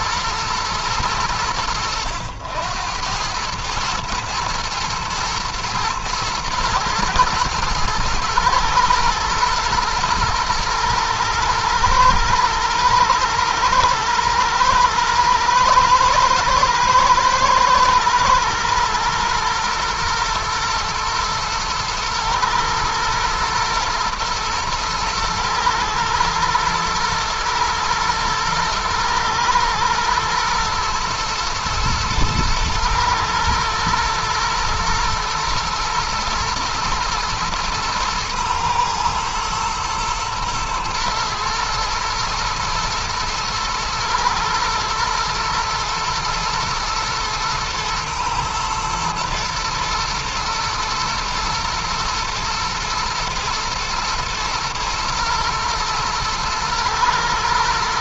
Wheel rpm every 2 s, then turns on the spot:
90, 100, 110, 110, 110, 110, 110, 120, 110, 110, 110, 110, 110, 110, 110, 120, 110, 110, 120, 110, 110, 110, 110, 110, 110, 110, 120, 120, 110.
none